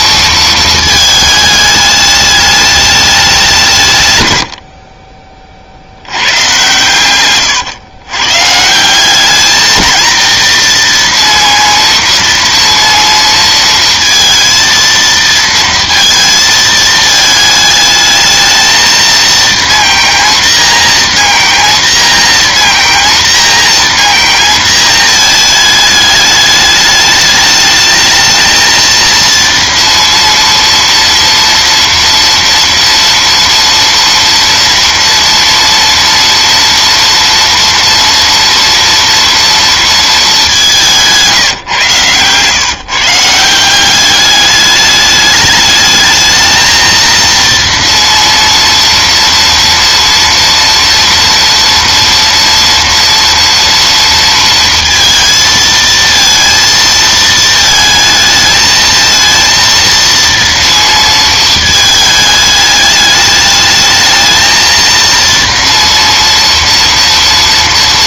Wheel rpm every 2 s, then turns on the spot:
220, 210, 70, 130, 180, 230, 230, 230, 220, 220, 230, 230, 220, 210, 230, 230, 230, 230, 230, 230, 200, 140, 210, 230, 230, 230, 230, 230, 230, 220, 230, 210, 230, 230.
none